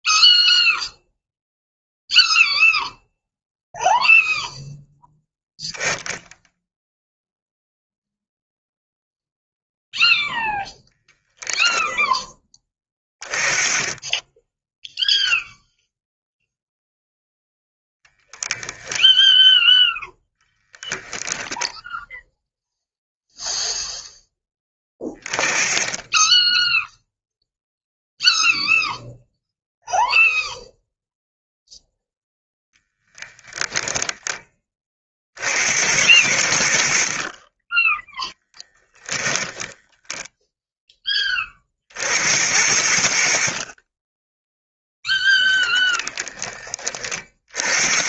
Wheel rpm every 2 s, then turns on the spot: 0, 0, 0, 0, 0, 0, 10, 0, 0, 0, 20, 0, 30, 0, 0, 0, 10, 30, 60, 10, 0, 70, 0, 30.
none